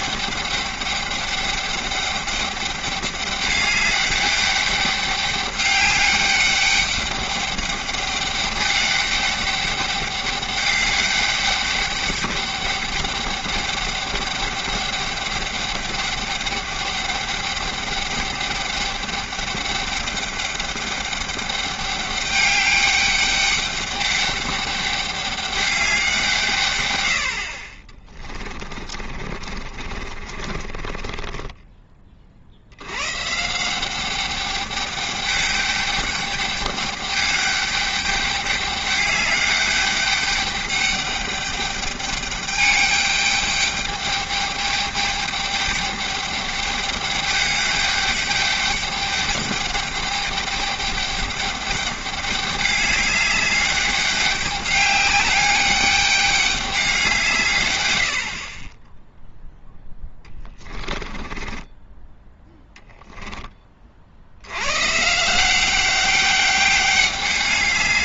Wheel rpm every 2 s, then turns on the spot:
200, 200, 200, 200, 200, 200, 200, 200, 200, 200, 200, 200, 200, 140, 30, 30, 90, 200, 210, 200, 200, 210, 210, 210, 210, 200, 200, 200, 200, 20, 20, 10, 110, 200.
28-32 60-62